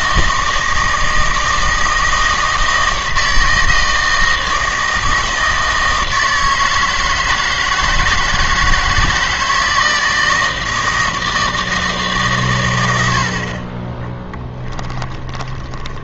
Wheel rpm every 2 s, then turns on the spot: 160, 160, 160, 160, 160, 160, 120, 10.
14-16